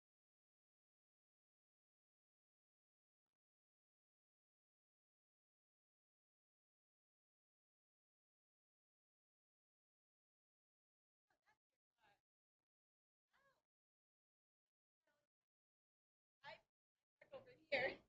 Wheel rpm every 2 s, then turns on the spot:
0, 0, 0, 0, 0, 0, 0, 0, 0.
none